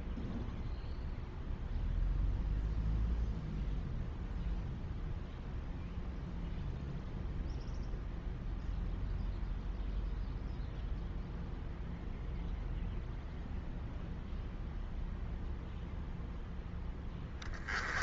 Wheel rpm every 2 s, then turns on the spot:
0, 0, 0, 0, 0, 0, 0, 0, 10.
none